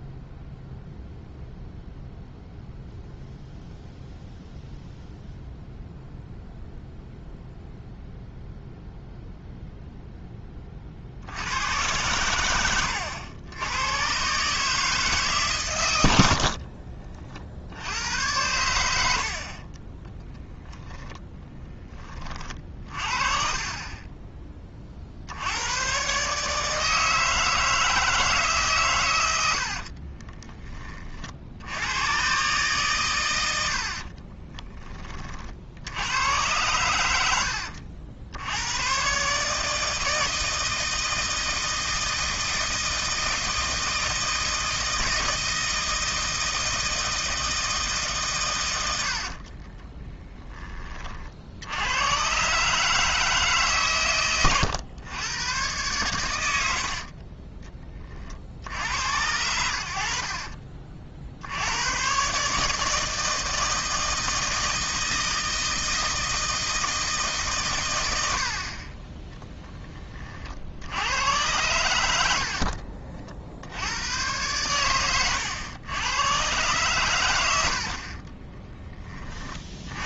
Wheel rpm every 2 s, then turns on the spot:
0, 0, 0, 0, 0, 50, 90, 150, 50, 80, 0, 40, 30, 150, 130, 20, 130, 20, 100, 110, 160, 160, 160, 160, 100, 40, 140, 110, 60, 80, 50, 160, 160, 160, 30, 70, 60, 100, 110, 10.
16-18 72-74